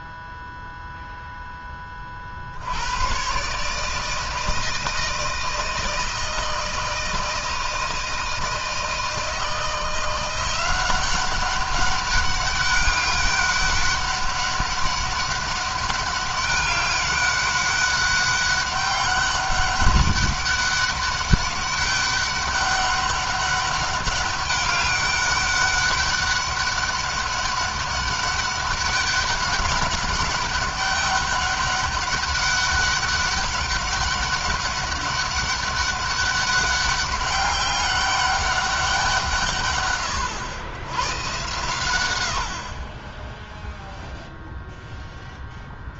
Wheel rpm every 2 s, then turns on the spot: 0, 60, 160, 160, 160, 180, 200, 200, 200, 200, 200, 200, 200, 200, 200, 200, 200, 200, 200, 200, 100, 70, 0.
none